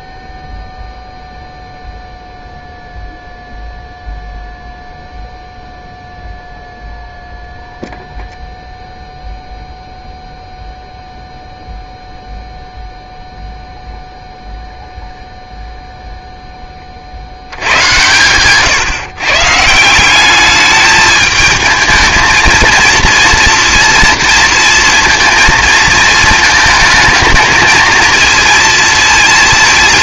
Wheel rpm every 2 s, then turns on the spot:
0, 0, 0, 0, 0, 0, 0, 0, 30, 160, 210, 230, 230, 220, 230.
none